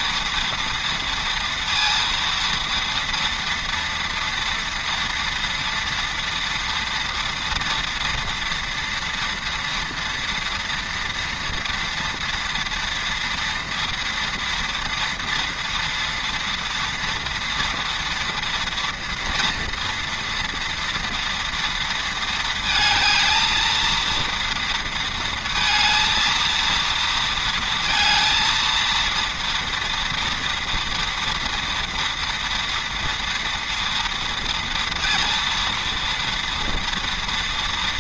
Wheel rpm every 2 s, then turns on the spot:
230, 230, 240, 230, 230, 240, 230, 230, 230, 230, 230, 220, 230, 230, 230, 230, 230, 230, 230.
none